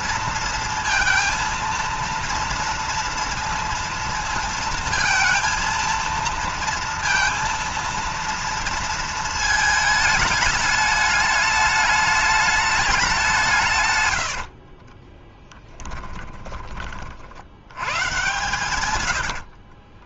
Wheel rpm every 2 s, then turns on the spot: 230, 230, 230, 230, 230, 210, 200, 40, 30, 110.
14-16 18-20